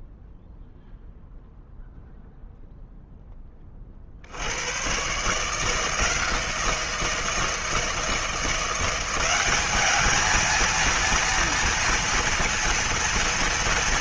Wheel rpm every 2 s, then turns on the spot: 0, 0, 110, 170, 180, 230, 230.
none